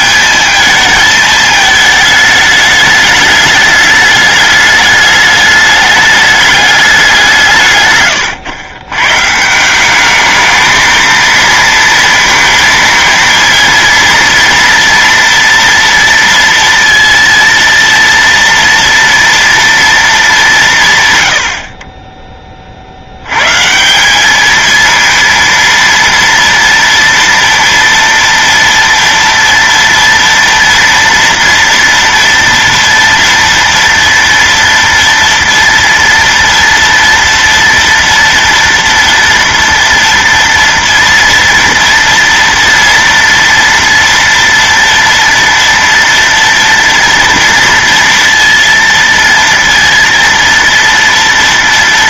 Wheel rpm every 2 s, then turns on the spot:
220, 210, 210, 210, 110, 220, 230, 230, 230, 230, 190, 30, 210, 230, 230, 230, 230, 230, 230, 230, 230, 230, 230, 230, 230, 230.
none